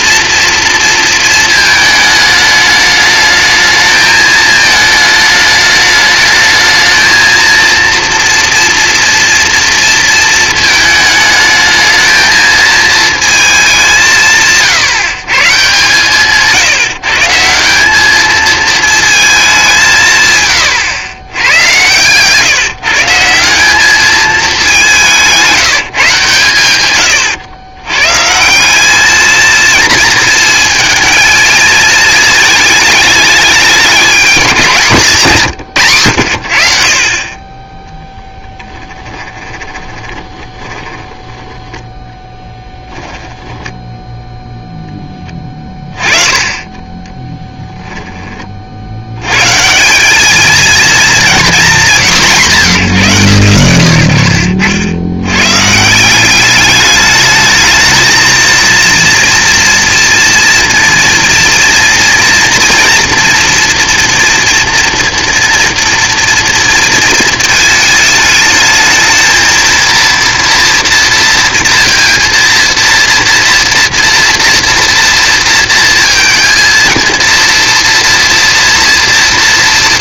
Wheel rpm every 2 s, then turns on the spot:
230, 210, 220, 220, 230, 220, 230, 150, 160, 220, 120, 140, 190, 120, 200, 230, 210, 180, 50, 20, 30, 10, 10, 20, 60, 230, 150, 80, 210, 230, 230, 230, 230, 230, 220, 230, 230, 230, 230, 230.
38-44